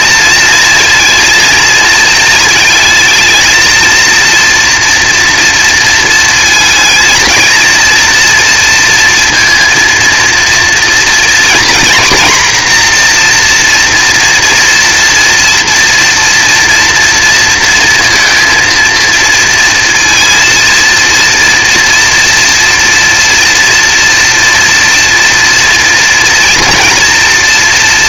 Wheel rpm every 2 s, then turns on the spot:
230, 220, 230, 220, 230, 230, 240, 240, 230, 230, 230, 230, 230, 230.
none